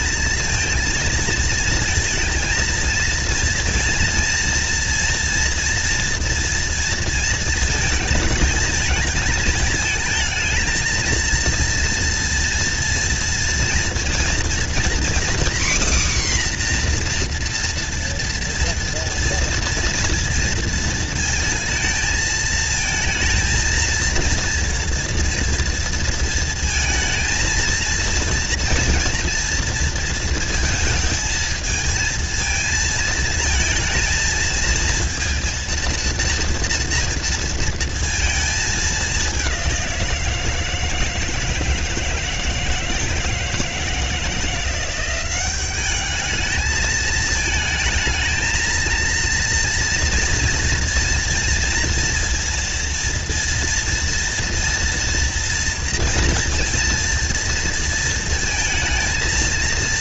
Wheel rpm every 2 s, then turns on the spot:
230, 230, 230, 230, 220, 220, 230, 240, 260, 240, 230, 220, 230, 230, 230, 220, 230, 230, 230, 220, 160, 160, 170, 210, 230, 230, 230, 230, 230, 220.
none